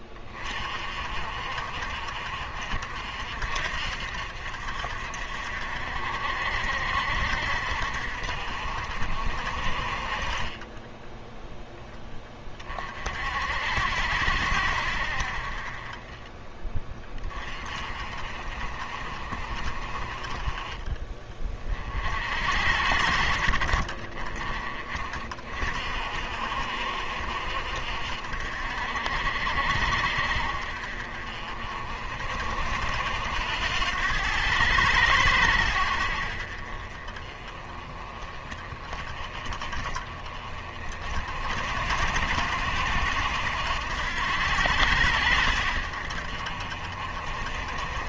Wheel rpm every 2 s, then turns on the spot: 50, 50, 60, 60, 50, 10, 40, 70, 20, 40, 20, 60, 30, 60, 60, 50, 60, 100, 40, 30, 40, 80, 90, 50.
none